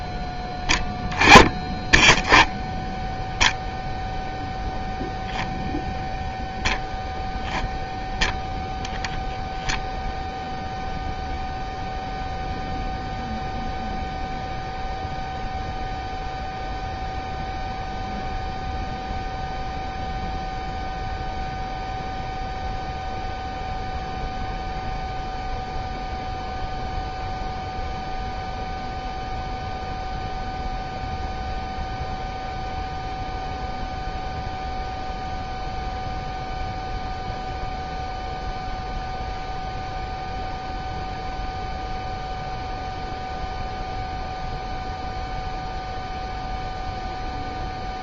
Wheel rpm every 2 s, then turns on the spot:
10, 0, 0, 0, 0, 0, 0, 0, 0, 0, 0, 0, 0, 0, 0, 0, 0, 0, 0, 0, 0, 0, 0, 0.
none